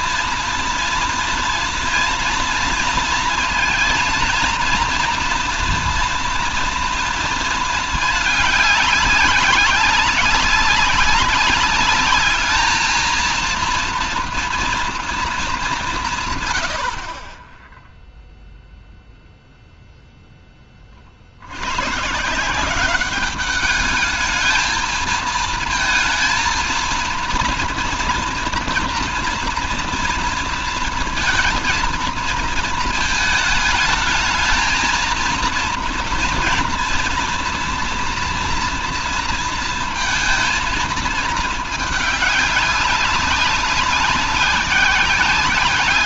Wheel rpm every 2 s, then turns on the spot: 240, 230, 230, 230, 210, 200, 220, 230, 90, 0, 20, 180, 220, 230, 230, 230, 230, 220, 230, 230, 230, 200, 190.
16-18